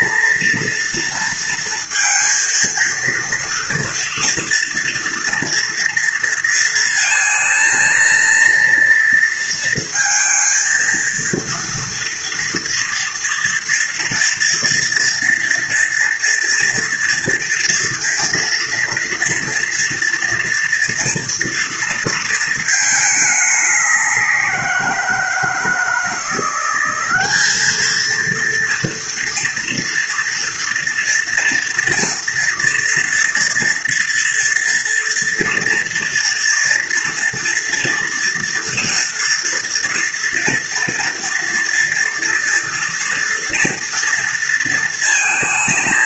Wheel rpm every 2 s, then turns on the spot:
230, 230, 230, 230, 230, 230, 230, 230, 230, 230, 230, 220, 180, 180, 230, 240, 230, 230, 230, 240, 230, 240, 230.
none